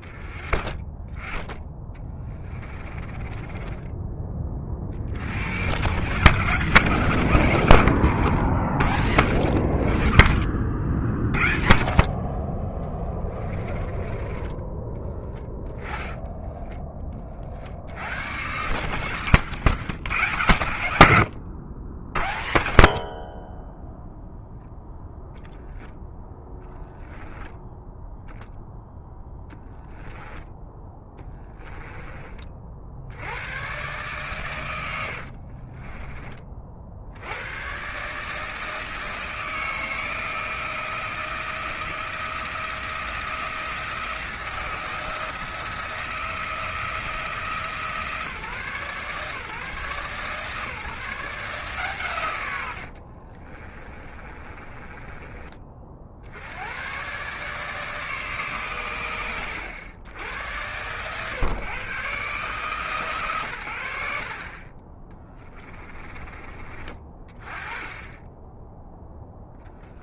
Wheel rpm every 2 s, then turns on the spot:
30, 30, 40, 140, 100, 60, 30, 10, 20, 120, 100, 40, 10, 10, 10, 10, 70, 90, 60, 160, 160, 170, 160, 160, 150, 150, 70, 20, 110, 120, 110, 150, 20, 30, 10.
2-4 12-16 18-20 30-32 34-36 52-56